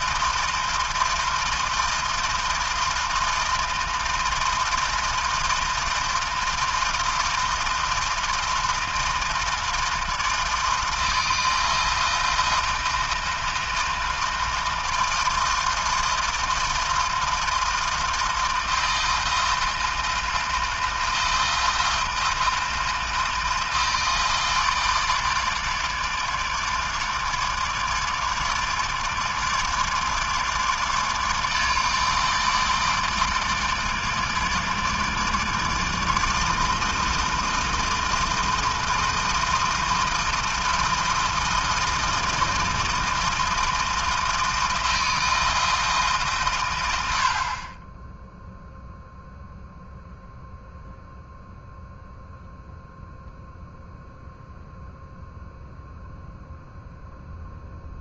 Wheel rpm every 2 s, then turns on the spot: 160, 160, 160, 160, 160, 160, 160, 160, 160, 160, 160, 160, 160, 150, 160, 150, 150, 150, 160, 160, 160, 160, 160, 130, 0, 0, 0, 0, 0.
none